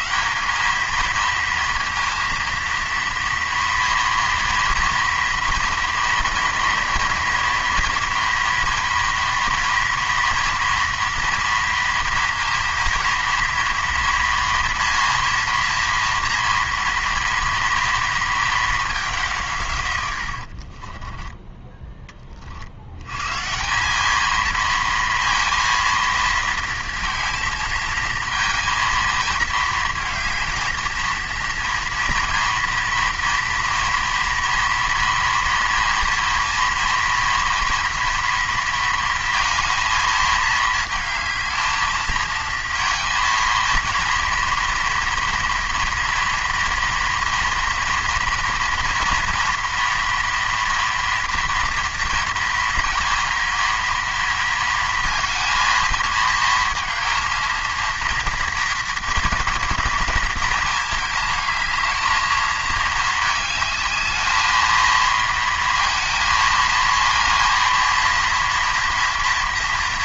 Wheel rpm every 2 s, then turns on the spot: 210, 230, 230, 230, 230, 230, 230, 230, 230, 220, 50, 50, 220, 230, 230, 230, 230, 230, 230, 230, 220, 230, 230, 230, 230, 230, 230, 230, 220, 240, 220, 220, 220, 230, 240.
20-22